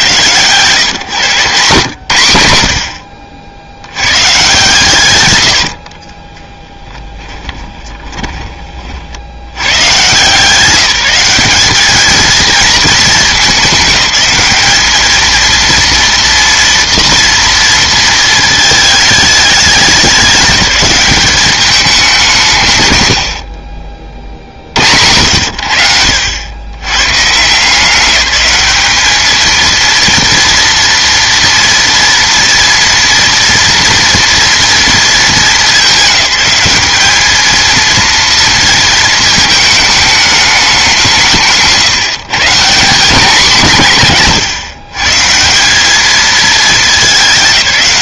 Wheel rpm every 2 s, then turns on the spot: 130, 80, 130, 20, 30, 160, 220, 200, 230, 220, 200, 150, 70, 110, 210, 230, 230, 230, 200, 230, 200, 180, 140, 220.
6-8